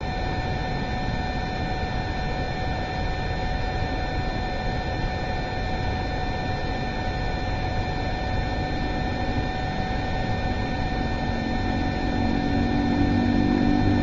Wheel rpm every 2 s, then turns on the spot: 0, 0, 0, 0, 0, 0, 0.
none